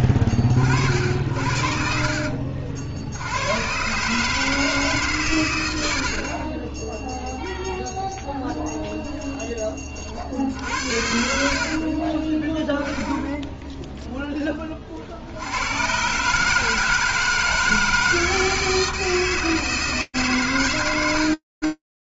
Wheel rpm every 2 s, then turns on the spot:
60, 70, 150, 10, 0, 70, 10, 40, 150, 160, 100.
12-14